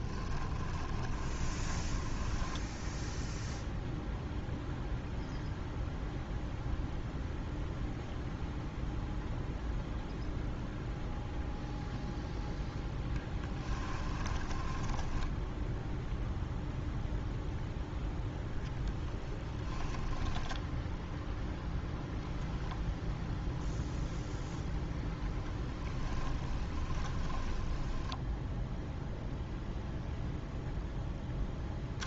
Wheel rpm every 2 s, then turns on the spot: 20, 0, 0, 0, 0, 0, 0, 10, 0, 10, 0, 0, 10, 20, 0, 0.
0-2 14-16 18-20 26-28